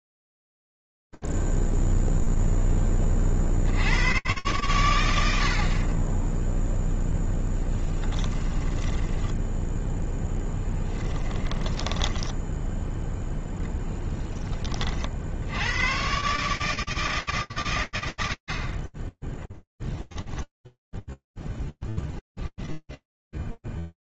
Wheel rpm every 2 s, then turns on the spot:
0, 0, 100, 0, 10, 10, 0, 30, 150, 30, 0, 10.
8-12